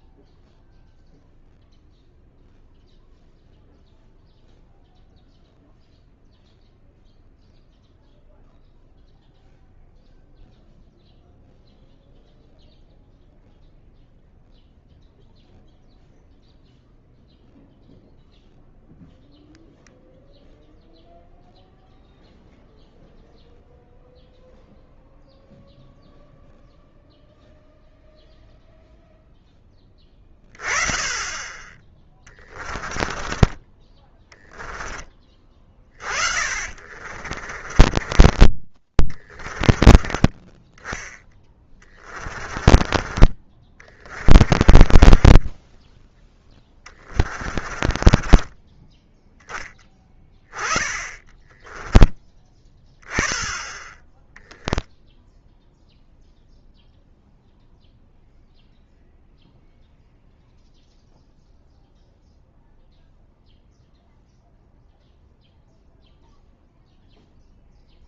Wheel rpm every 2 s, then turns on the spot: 0, 0, 0, 0, 0, 0, 0, 0, 0, 0, 0, 0, 0, 0, 0, 20, 20, 10, 50, 20, 10, 30, 20, 20, 20, 20, 10, 0, 0, 0, 0, 0, 0, 0.
32-34 36-40 42-50